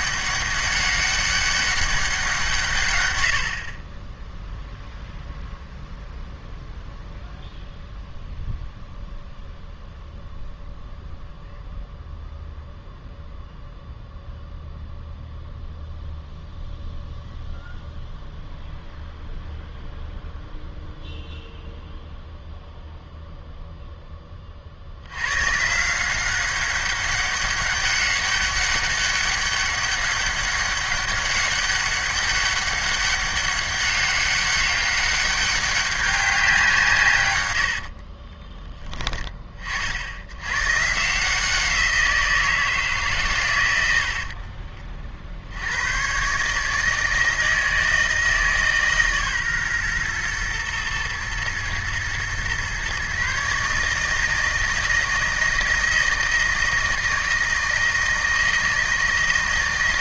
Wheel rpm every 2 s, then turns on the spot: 200, 160, 0, 0, 0, 0, 0, 0, 0, 0, 0, 0, 40, 190, 200, 200, 200, 200, 180, 20, 110, 160, 40, 140, 150, 120, 120, 160, 160, 160.
38-40 44-46